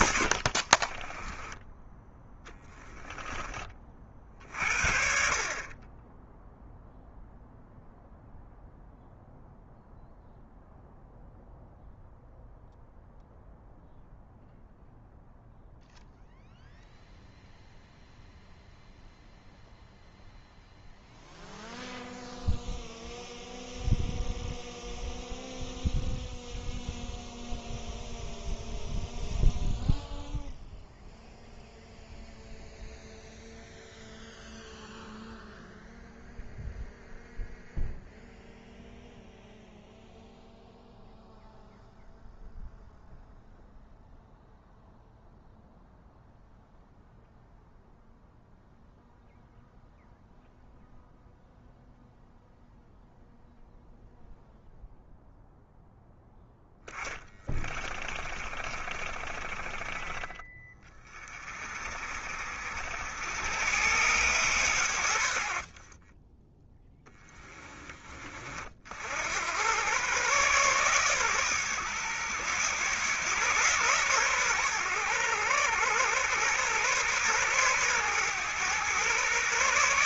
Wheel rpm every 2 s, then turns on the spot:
30, 10, 50, 0, 0, 0, 0, 0, 0, 0, 0, 0, 0, 0, 0, 0, 0, 0, 0, 0, 0, 0, 0, 0, 0, 0, 0, 0, 20, 30, 30, 80, 100, 10, 50, 120, 120, 100, 120, 120.
0-2 56-60